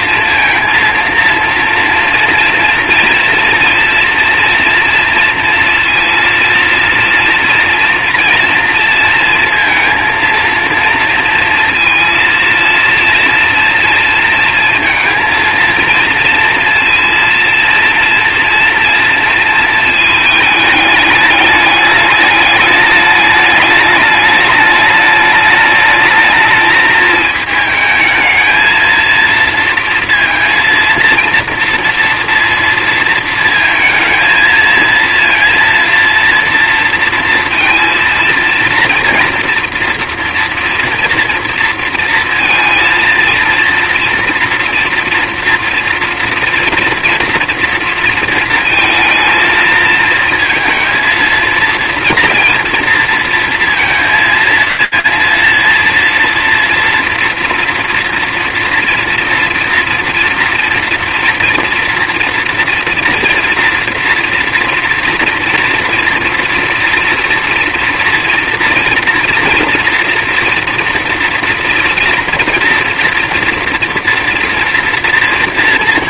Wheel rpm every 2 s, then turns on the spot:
230, 230, 230, 230, 230, 230, 230, 230, 230, 230, 210, 210, 210, 220, 220, 230, 230, 230, 230, 230, 230, 230, 230, 230, 230, 230, 230, 220, 230, 240, 230, 230, 230, 230, 230, 230, 230, 240.
none